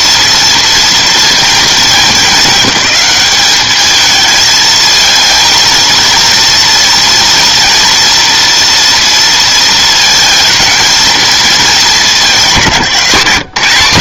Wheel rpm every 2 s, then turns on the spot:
230, 210, 220, 230, 230, 220, 190.
none